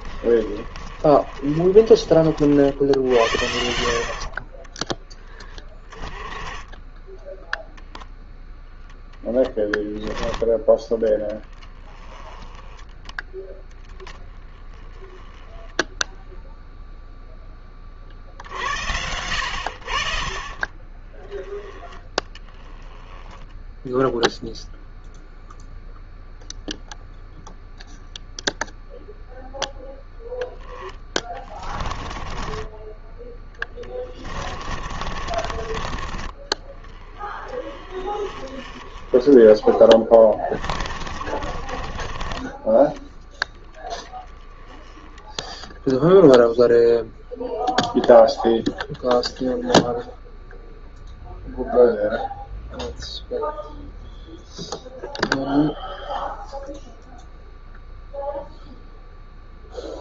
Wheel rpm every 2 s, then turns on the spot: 40, 70, 20, 10, 10, 20, 10, 10, 0, 70, 20, 10, 0, 0, 0, 10, 10, 30, 30, 20, 30, 30, 10, 0, 0, 0, 0, 0, 0, 0.
30-32 34-36 40-44